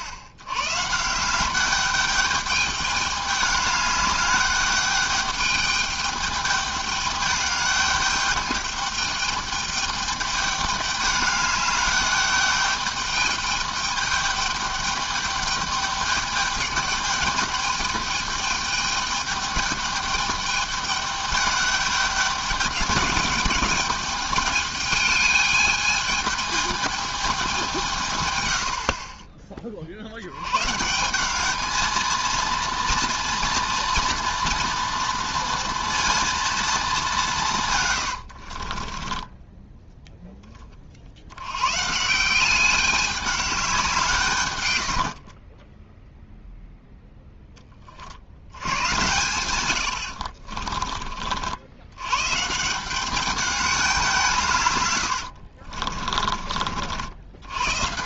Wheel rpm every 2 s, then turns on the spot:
120, 210, 210, 210, 200, 210, 200, 210, 210, 210, 210, 200, 210, 220, 90, 120, 230, 230, 230, 50, 20, 190, 120, 0, 80, 40, 160, 140, 50.
38-40 50-52